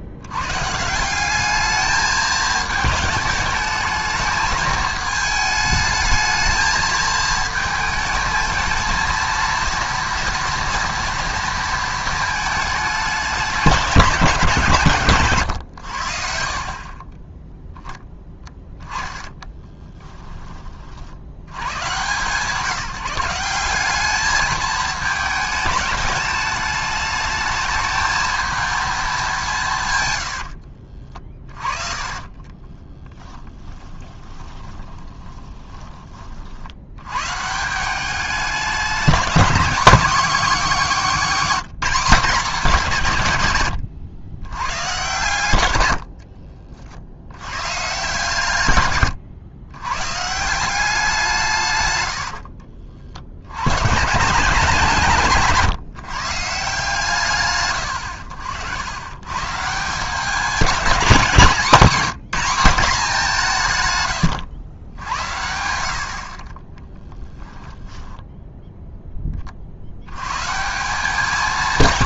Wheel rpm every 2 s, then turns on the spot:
140, 220, 220, 220, 220, 240, 210, 170, 50, 10, 30, 170, 220, 210, 220, 60, 30, 20, 60, 200, 220, 210, 110, 50, 130, 190, 70, 160, 150, 90, 210, 200, 100, 20, 0, 150.
30-36 52-54 66-68